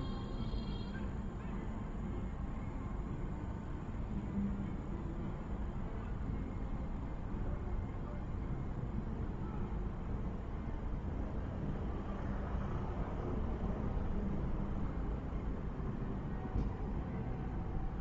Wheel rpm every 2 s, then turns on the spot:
0, 0, 0, 0, 0, 0, 0, 0, 0.
none